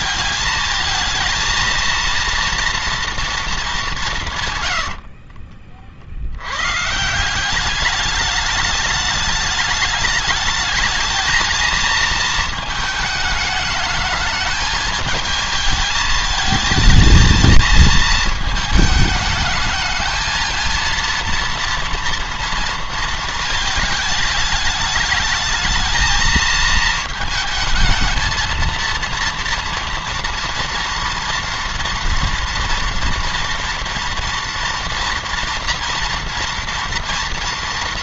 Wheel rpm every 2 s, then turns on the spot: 220, 230, 60, 160, 210, 220, 210, 220, 220, 220, 230, 230, 210, 220, 230, 230, 230, 230, 230.
4-6